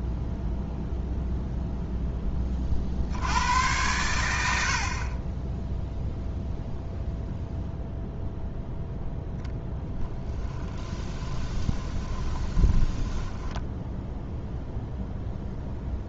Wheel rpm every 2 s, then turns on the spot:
0, 50, 60, 0, 0, 20, 20, 0.
10-14